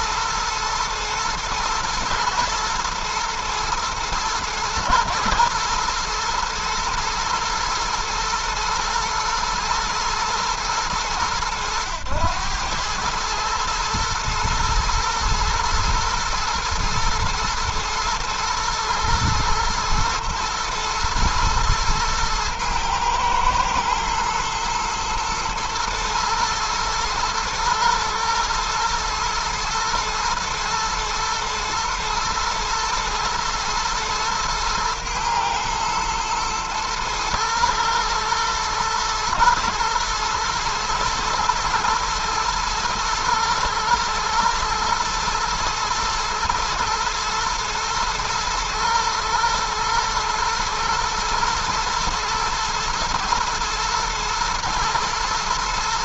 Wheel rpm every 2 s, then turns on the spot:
120, 110, 110, 110, 120, 110, 110, 110, 110, 120, 110, 110, 120, 110, 120, 120, 110, 110, 110, 110, 110, 110, 110, 110, 110, 110, 110, 110.
none